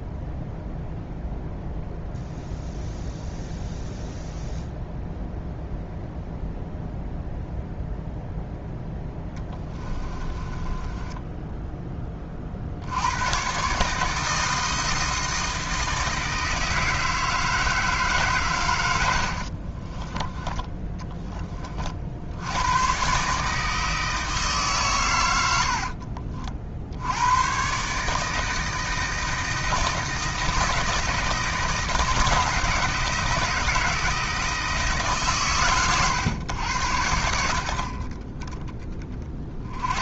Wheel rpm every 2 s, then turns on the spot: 0, 0, 0, 0, 0, 20, 80, 160, 160, 100, 10, 110, 130, 70, 160, 160, 160, 160, 90, 20.
10-12 20-22